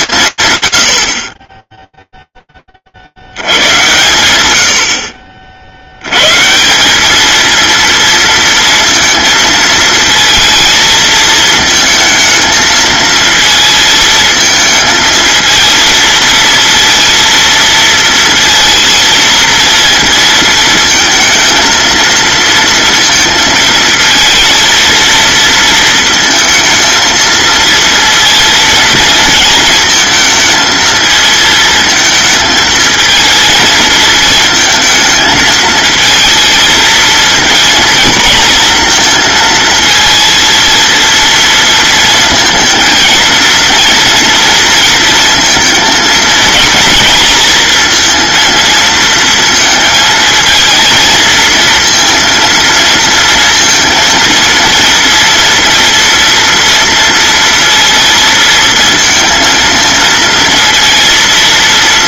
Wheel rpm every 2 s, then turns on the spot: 70, 10, 100, 160, 230, 230, 220, 220, 230, 230, 230, 230, 230, 230, 230, 220, 220, 220, 220, 230, 230, 230, 230, 230, 230, 220, 230, 230, 230, 230, 230.
none